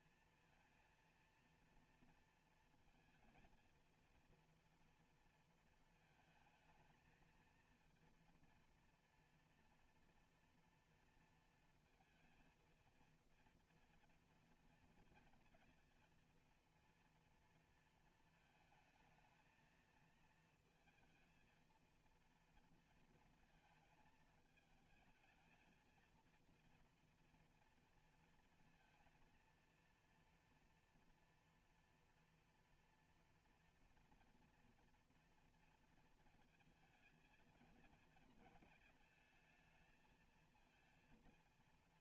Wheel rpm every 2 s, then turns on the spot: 230, 220, 230, 220, 230, 240, 230, 230, 230, 220, 230, 230, 220, 230, 230, 230, 240, 240, 230, 220, 230.
none